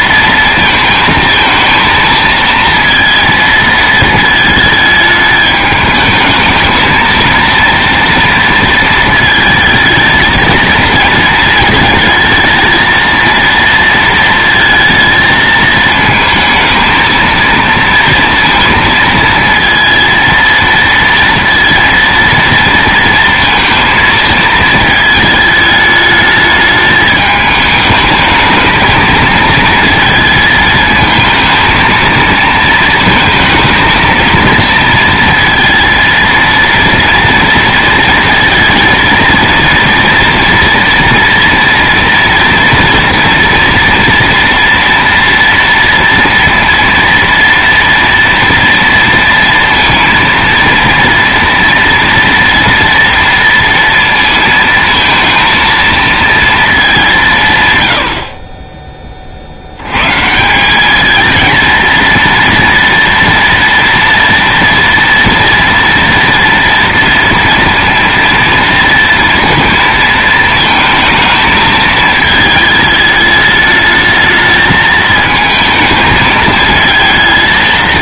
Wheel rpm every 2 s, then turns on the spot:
230, 230, 220, 220, 220, 230, 220, 220, 220, 230, 230, 230, 220, 210, 220, 220, 220, 230, 230, 230, 230, 230, 230, 230, 230, 230, 230, 230, 210, 20, 200, 230, 230, 230, 230, 220, 220, 220, 220.
none